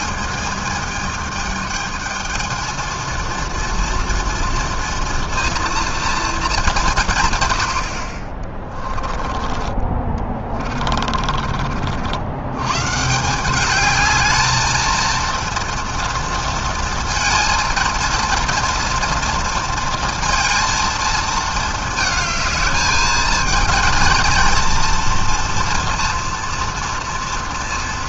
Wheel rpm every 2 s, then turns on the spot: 220, 230, 240, 130, 20, 40, 170, 230, 230, 230, 220, 210, 230, 230.
8-12